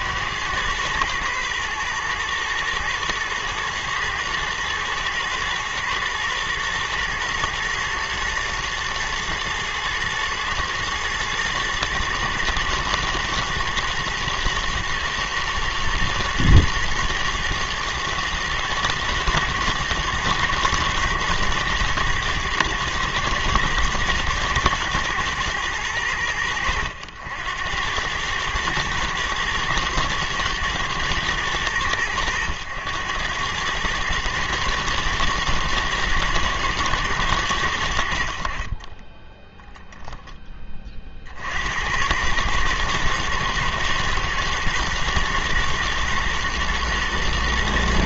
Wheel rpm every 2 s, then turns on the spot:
120, 110, 120, 120, 110, 110, 110, 120, 110, 110, 110, 110, 110, 90, 110, 120, 100, 120, 110, 40, 20, 110, 120, 120.
none